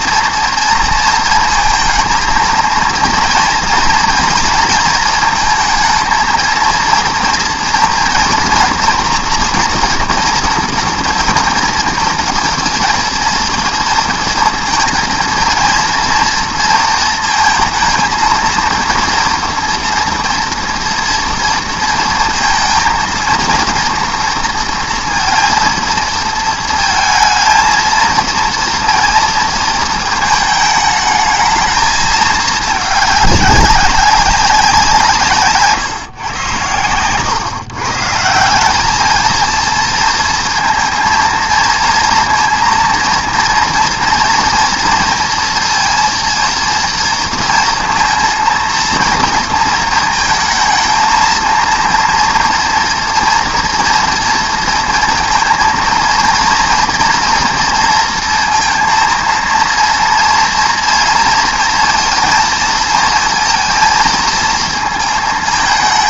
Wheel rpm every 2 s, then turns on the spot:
230, 230, 230, 230, 240, 230, 230, 230, 230, 230, 230, 230, 230, 220, 230, 220, 210, 180, 110, 190, 230, 230, 230, 230, 230, 230, 230, 230, 230, 230, 230, 230, 230.
none